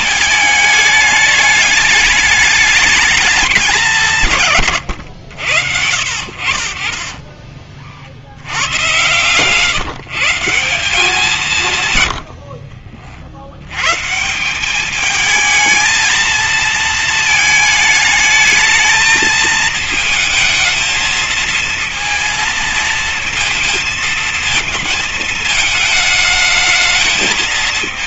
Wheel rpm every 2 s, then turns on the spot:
210, 210, 150, 60, 110, 190, 70, 180, 230, 220, 220, 230, 230, 220.
4-6 12-14